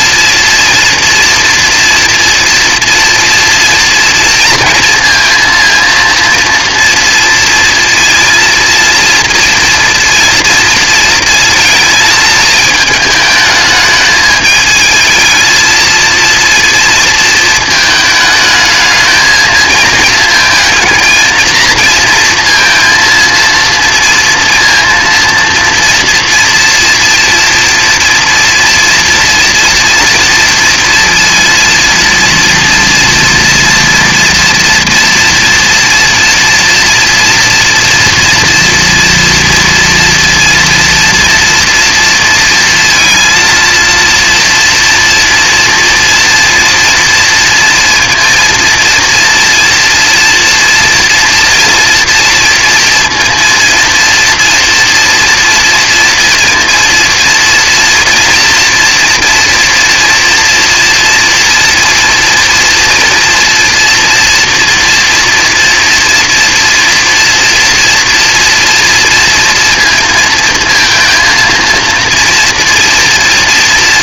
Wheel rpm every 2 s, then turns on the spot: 230, 230, 230, 230, 230, 230, 220, 210, 230, 220, 220, 230, 230, 230, 230, 230, 240, 240, 230, 230, 230, 230, 230, 230, 230, 230, 240, 230, 230, 240, 230, 230, 230, 230, 230, 230, 230.
none